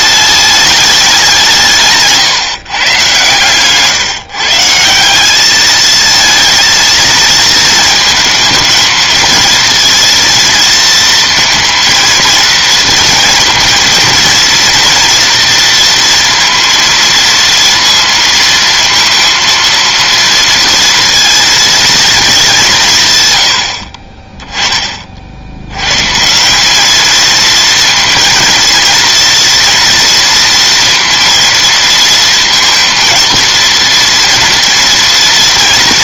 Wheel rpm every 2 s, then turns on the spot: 210, 150, 150, 220, 220, 230, 230, 230, 230, 230, 230, 200, 20, 170, 230, 230, 230, 230.
none